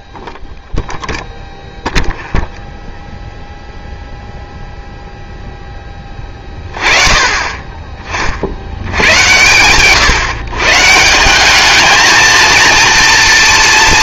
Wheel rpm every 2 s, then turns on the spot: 0, 0, 0, 20, 70, 140, 230.
none